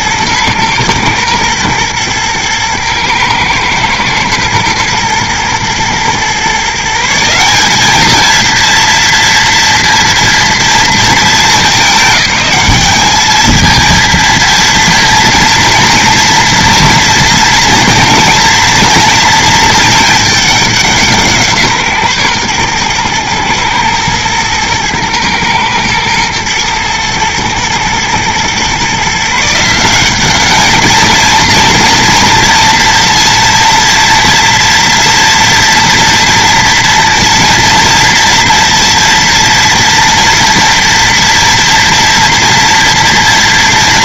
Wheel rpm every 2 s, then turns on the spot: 120, 110, 110, 160, 230, 220, 210, 230, 230, 230, 180, 120, 110, 110, 130, 220, 230, 230, 230, 230, 230, 240.
none